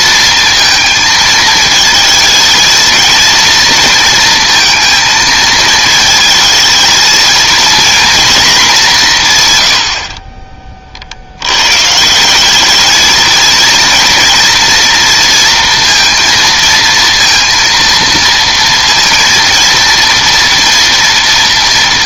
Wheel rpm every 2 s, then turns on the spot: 230, 230, 230, 220, 210, 30, 200, 230, 230, 230, 240.
none